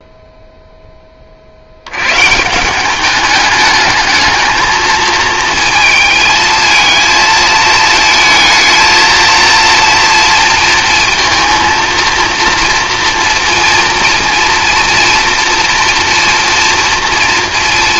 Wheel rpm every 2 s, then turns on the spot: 10, 190, 230, 220, 220, 230, 230, 230, 230.
none